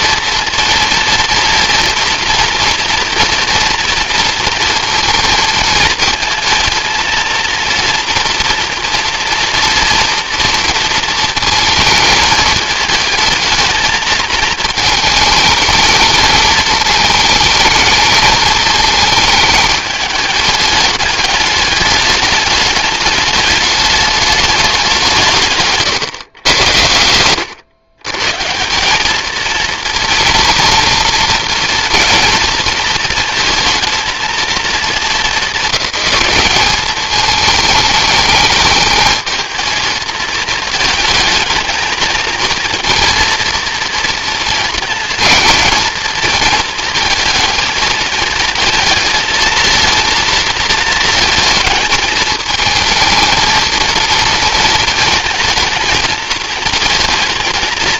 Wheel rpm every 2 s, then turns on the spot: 230, 230, 230, 230, 230, 230, 220, 220, 220, 220, 210, 210, 200, 100, 170, 230, 230, 230, 200, 210, 220, 230, 230, 230, 220, 220, 220, 230, 220.
none